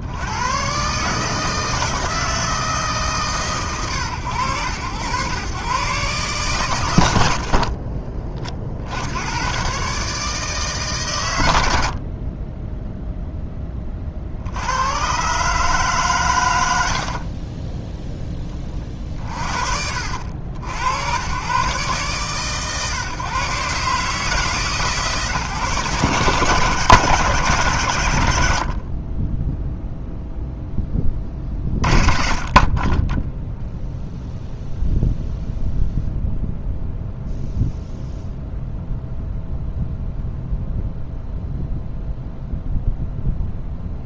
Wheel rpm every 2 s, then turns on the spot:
90, 160, 100, 110, 60, 150, 20, 70, 90, 40, 70, 130, 150, 130, 60, 20, 20, 0, 0, 0, 0, 0.
28-30